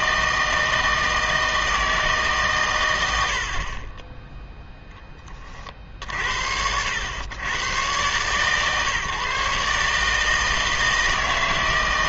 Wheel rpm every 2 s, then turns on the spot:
160, 120, 0, 80, 140, 160.
none